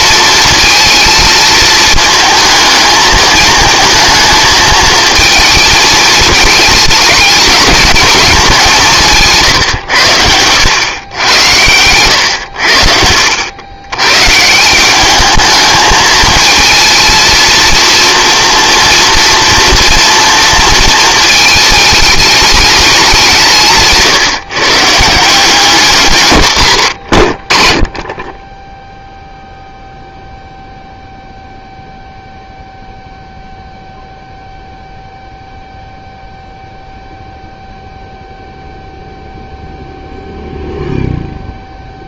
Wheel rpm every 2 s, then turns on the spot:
230, 220, 220, 220, 180, 100, 80, 170, 220, 230, 230, 210, 140, 90, 10, 0, 0, 0, 0, 0, 0.
none